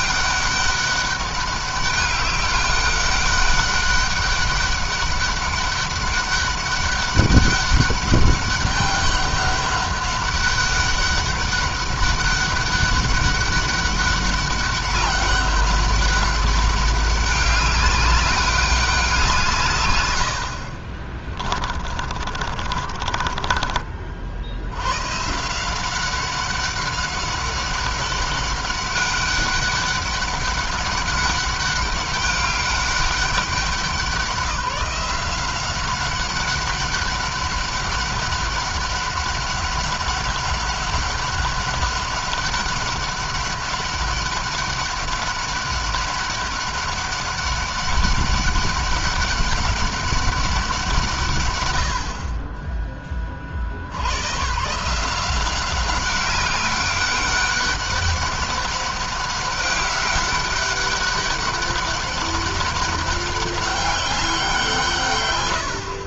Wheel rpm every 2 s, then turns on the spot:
200, 200, 200, 200, 200, 200, 200, 200, 200, 200, 60, 30, 90, 190, 200, 200, 200, 190, 190, 200, 200, 200, 200, 200, 200, 170, 20, 140, 200, 200, 200, 200, 160.
20-24